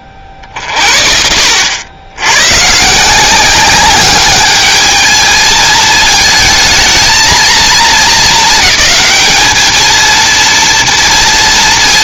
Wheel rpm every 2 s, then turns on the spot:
40, 130, 210, 220, 210, 230.
none